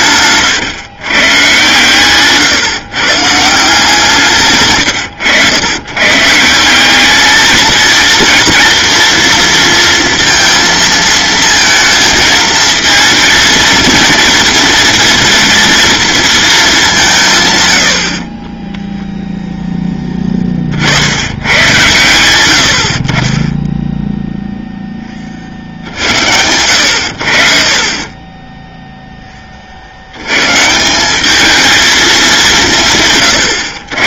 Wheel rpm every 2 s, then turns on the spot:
120, 130, 120, 190, 230, 230, 220, 230, 190, 10, 60, 70, 10, 90, 0, 170, 160.
4-6